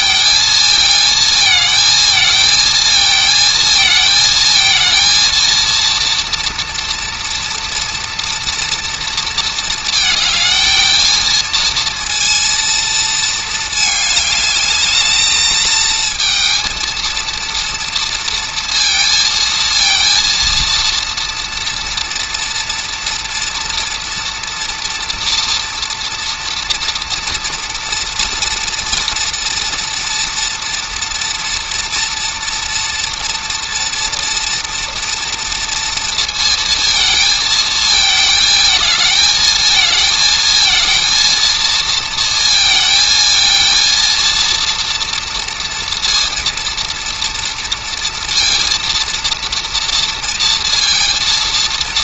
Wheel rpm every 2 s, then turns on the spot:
220, 220, 230, 230, 230, 220, 230, 210, 230, 230, 230, 230, 230, 230, 230, 240, 230, 230, 220, 220, 230, 230, 230, 230, 230, 230.
none